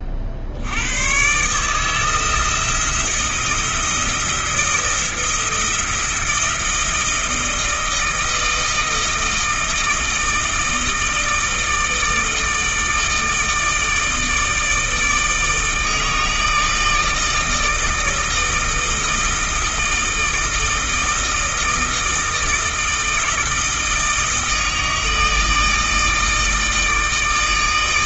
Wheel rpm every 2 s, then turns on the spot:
100, 170, 170, 160, 160, 160, 160, 160, 160, 160, 160, 160, 160, 160.
none